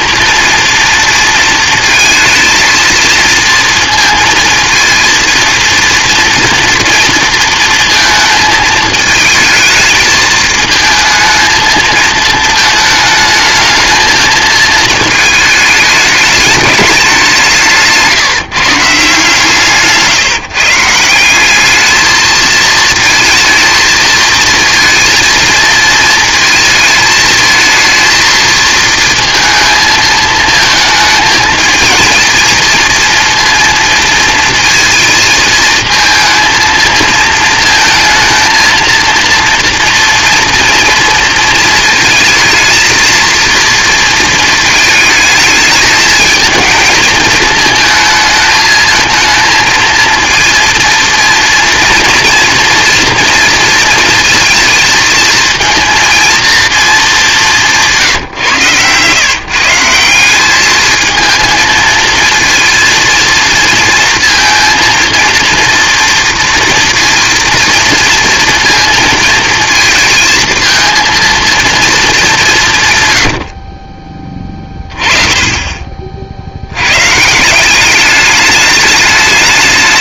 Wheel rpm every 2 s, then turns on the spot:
230, 230, 230, 230, 220, 220, 220, 220, 210, 160, 150, 220, 230, 220, 230, 220, 230, 230, 220, 230, 230, 230, 220, 220, 220, 230, 230, 230, 230, 120, 220, 230, 230, 230, 230, 230, 170, 20, 70, 210.
none